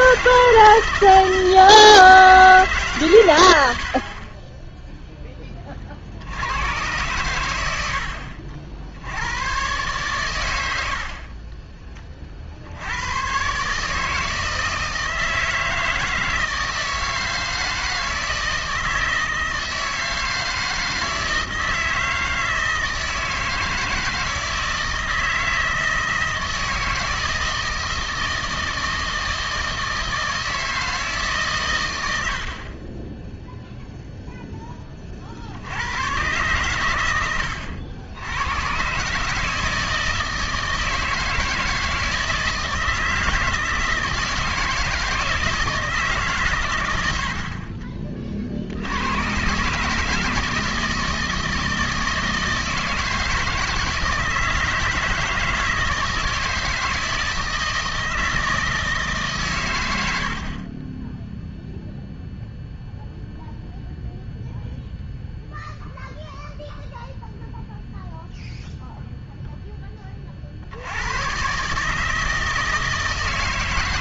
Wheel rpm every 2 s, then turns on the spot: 160, 150, 10, 100, 70, 80, 60, 160, 160, 160, 160, 160, 160, 160, 160, 160, 50, 10, 120, 110, 160, 160, 160, 120, 60, 160, 160, 160, 160, 160, 40, 0, 0, 0, 0, 70, 160.
4-6